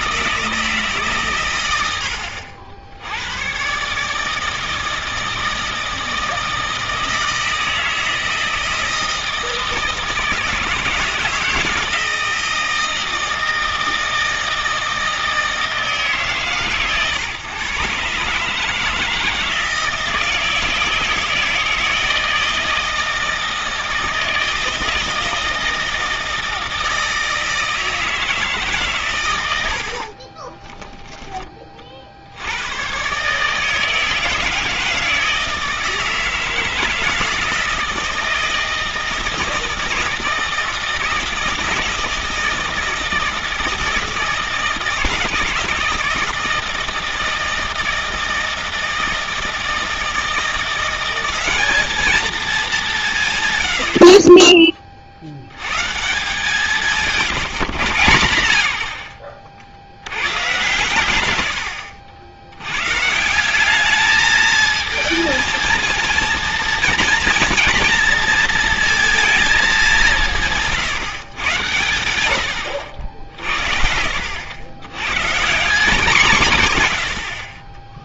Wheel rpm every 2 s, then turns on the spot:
160, 70, 160, 160, 160, 160, 160, 160, 140, 150, 170, 160, 160, 160, 150, 20, 100, 160, 160, 160, 160, 160, 160, 160, 160, 170, 230, 30, 160, 80, 130, 100, 220, 240, 230, 140, 90, 90, 140.
30-32 72-74